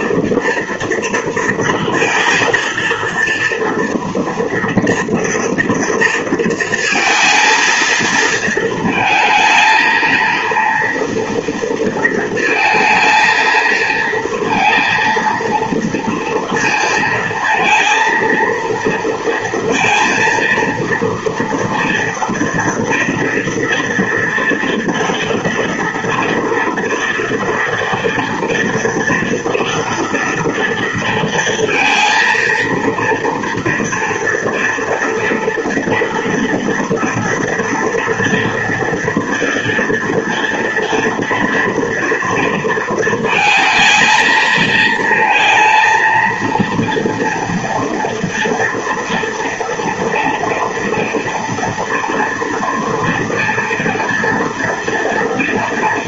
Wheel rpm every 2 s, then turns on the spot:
230, 230, 230, 230, 220, 230, 220, 230, 230, 230, 230, 230, 230, 240, 240, 230, 230, 230, 230, 230, 230, 230, 220, 230, 230, 230, 230, 230.
none